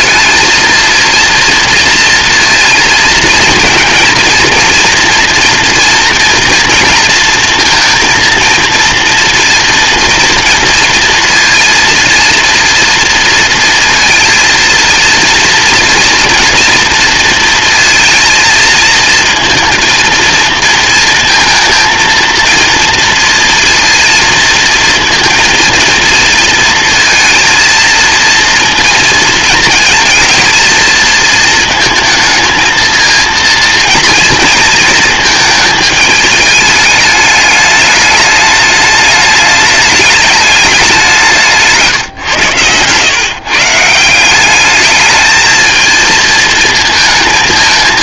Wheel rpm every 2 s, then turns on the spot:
230, 230, 230, 230, 230, 230, 230, 230, 230, 230, 230, 230, 230, 230, 230, 230, 230, 220, 210, 210, 200, 120, 210, 230.
none